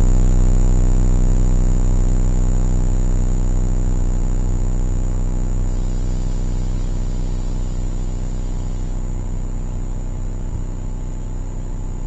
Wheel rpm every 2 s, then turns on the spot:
0, 0, 0, 0, 0, 0.
none